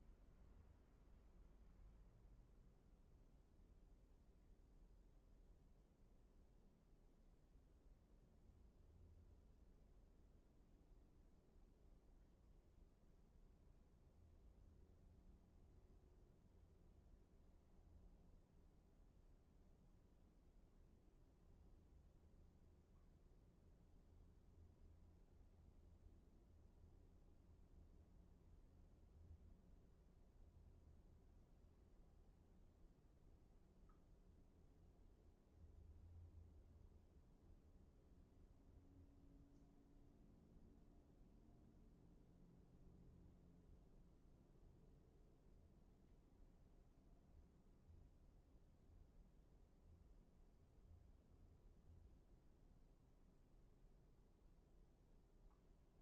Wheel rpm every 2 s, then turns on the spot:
0, 0, 0, 0, 0, 0, 0, 0, 0, 0, 0, 0, 0, 0, 0, 0, 0, 0, 0, 0, 0, 0, 0, 0, 0, 0, 0, 0.
none